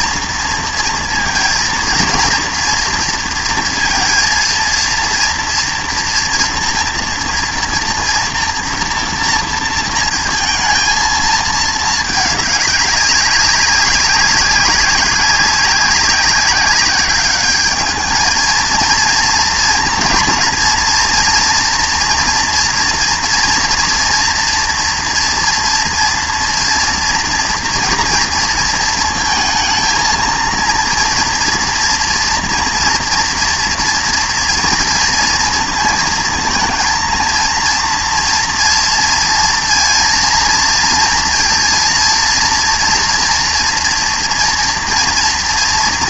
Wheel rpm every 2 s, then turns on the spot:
230, 240, 230, 240, 230, 220, 200, 190, 190, 230, 230, 240, 230, 240, 230, 230, 240, 240, 230, 240, 230, 240, 230.
none